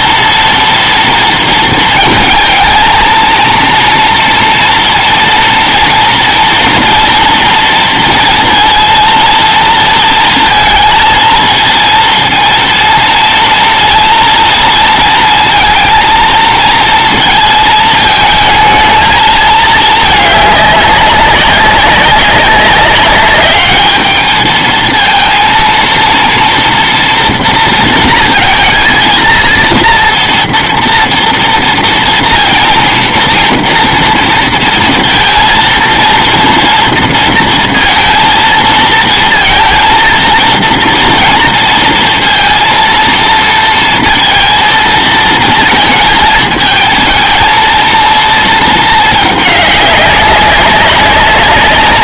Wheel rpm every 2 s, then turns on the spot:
230, 220, 230, 230, 230, 220, 230, 230, 230, 220, 210, 200, 220, 230, 230, 230, 230, 230, 230, 230, 230, 230, 230, 220, 230, 200.
none